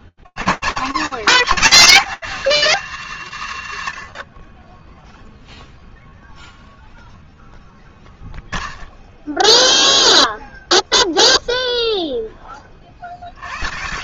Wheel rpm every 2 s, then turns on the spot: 60, 280, 110, 0, 0, 0, 60.
none